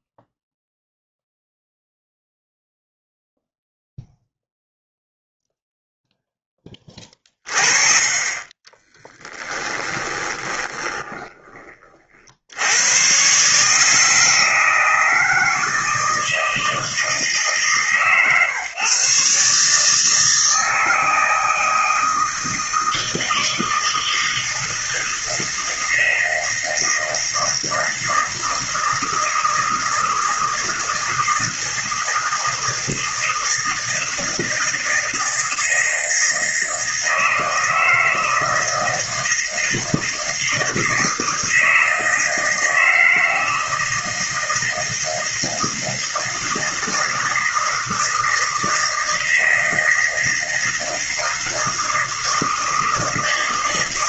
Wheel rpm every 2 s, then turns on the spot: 0, 0, 0, 0, 30, 20, 60, 160, 160, 140, 160, 160, 160, 160, 160, 160, 160, 160, 160, 160, 160, 160, 160, 160, 160, 160, 160.
10-12